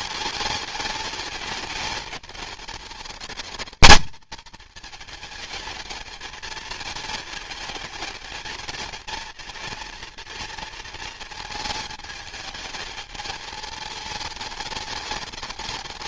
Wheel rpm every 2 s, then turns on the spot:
220, 210, 220, 220, 220, 230, 220, 210.
none